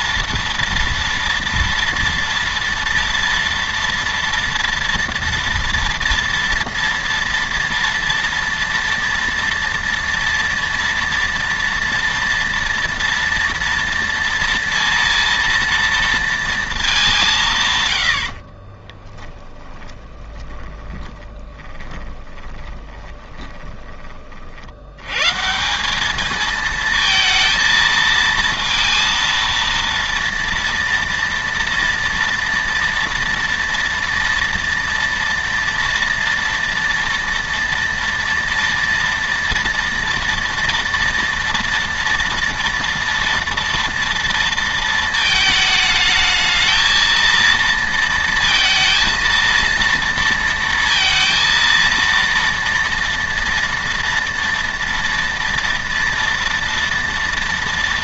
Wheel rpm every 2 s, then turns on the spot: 230, 230, 230, 230, 230, 230, 230, 230, 220, 40, 40, 20, 60, 220, 230, 230, 230, 230, 230, 240, 230, 230, 230, 220, 230, 230, 230, 230, 230.
18-24